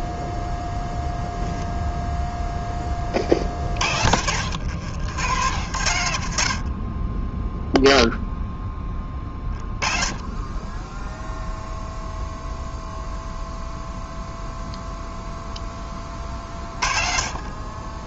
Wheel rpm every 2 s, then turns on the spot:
0, 30, 90, 20, 10, 10, 0, 0, 40.
none